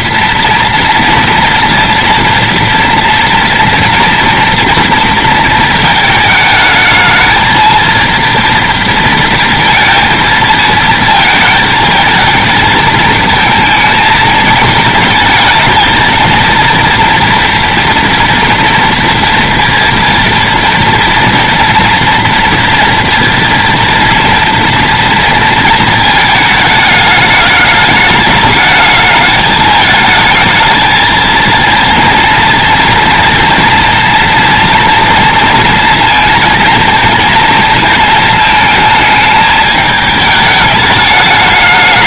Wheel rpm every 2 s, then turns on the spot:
240, 230, 230, 220, 230, 220, 220, 220, 240, 230, 230, 230, 230, 210, 220, 220, 230, 230, 230, 210, 210.
none